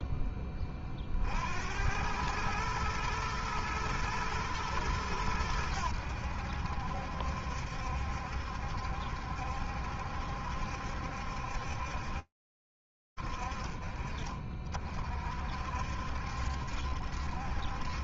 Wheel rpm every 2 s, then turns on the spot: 40, 110, 100, 70, 70, 70, 50, 60, 70.
none